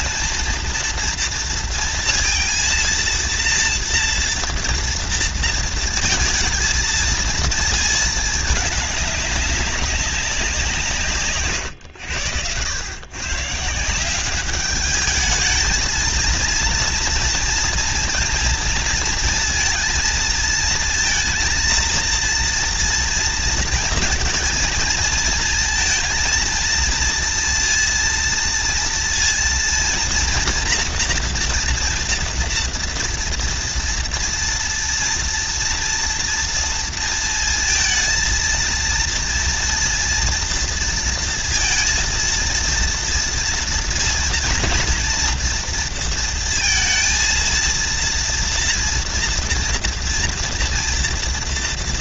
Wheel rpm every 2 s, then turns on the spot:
230, 230, 230, 230, 210, 180, 100, 200, 230, 230, 220, 230, 230, 230, 230, 230, 230, 230, 230, 230, 230, 230, 230, 230, 230, 240.
none